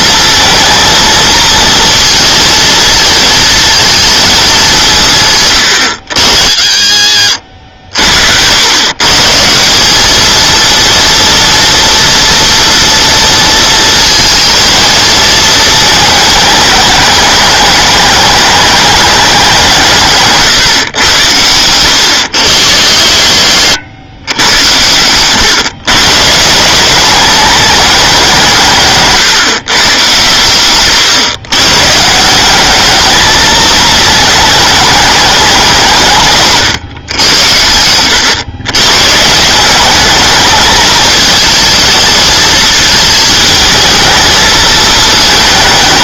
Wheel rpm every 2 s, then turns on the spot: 230, 230, 190, 60, 110, 230, 230, 230, 210, 210, 130, 70, 100, 180, 170, 120, 210, 210, 140, 120, 220, 220, 220.
none